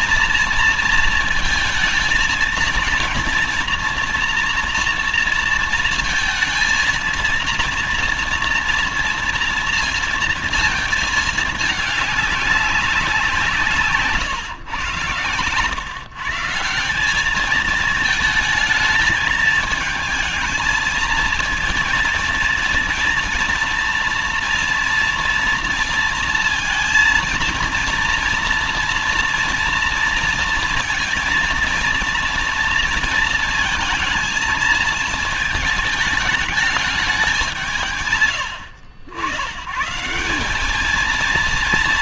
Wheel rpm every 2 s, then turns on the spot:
230, 230, 240, 230, 230, 230, 200, 120, 150, 220, 220, 230, 230, 230, 230, 230, 230, 220, 210, 100, 180.
none